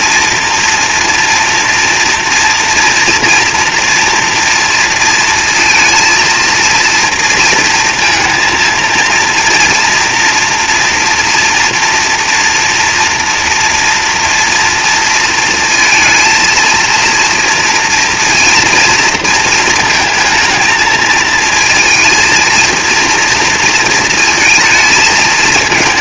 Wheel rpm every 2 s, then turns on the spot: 230, 230, 230, 230, 230, 230, 240, 230, 230, 230, 220, 230, 230.
none